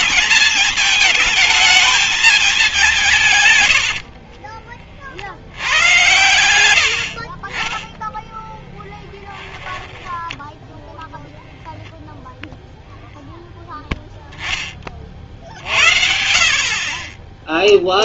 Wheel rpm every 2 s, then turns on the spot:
220, 210, 40, 100, 10, 10, 0, 10, 40.
4-6